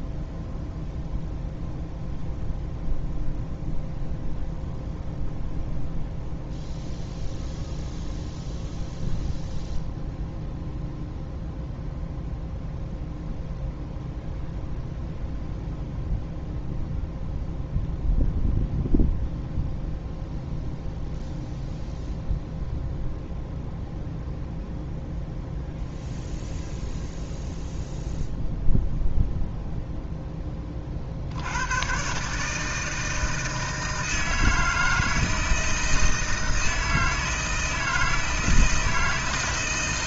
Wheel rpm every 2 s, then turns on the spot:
0, 0, 0, 0, 0, 0, 0, 0, 0, 0, 0, 0, 0, 0, 0, 20, 150, 160, 160, 160.
none